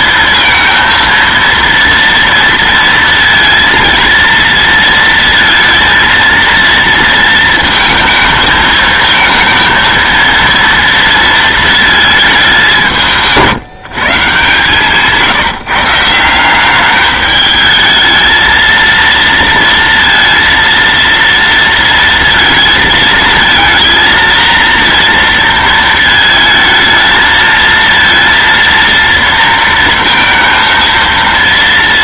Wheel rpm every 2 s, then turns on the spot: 230, 230, 230, 230, 220, 230, 220, 140, 170, 220, 230, 230, 230, 220, 230, 230.
none